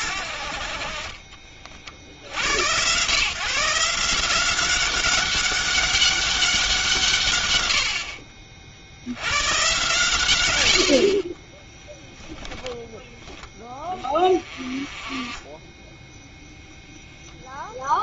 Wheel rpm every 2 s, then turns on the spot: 40, 130, 190, 160, 70, 70, 10, 30, 0.
none